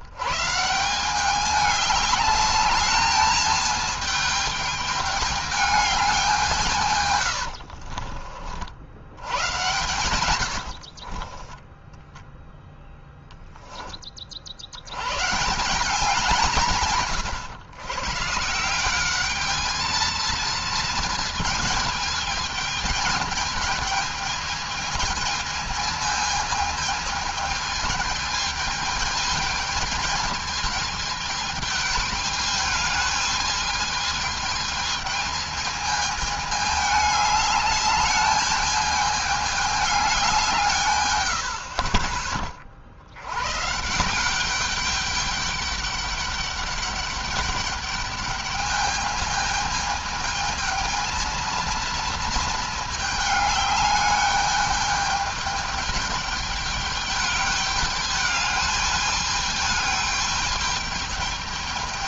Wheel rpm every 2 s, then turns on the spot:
160, 210, 220, 170, 60, 100, 0, 60, 170, 160, 230, 210, 220, 220, 220, 220, 210, 220, 210, 210, 170, 30, 190, 200, 210, 220, 220, 210, 210, 210, 210.
10-12